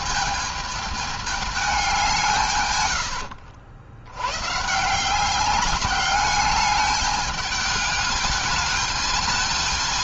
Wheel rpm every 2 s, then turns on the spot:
220, 120, 140, 210, 210.
none